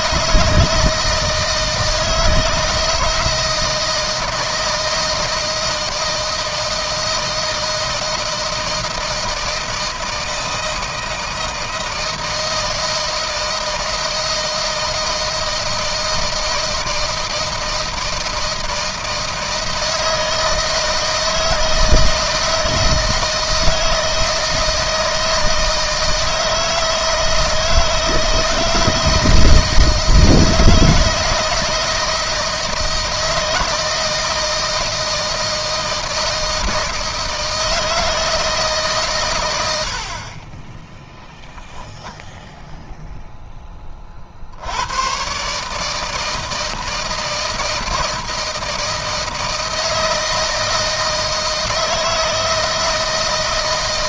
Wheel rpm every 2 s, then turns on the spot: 160, 160, 160, 160, 160, 160, 160, 160, 160, 160, 160, 160, 160, 160, 160, 160, 160, 160, 160, 160, 40, 0, 60, 160, 160, 160, 160.
none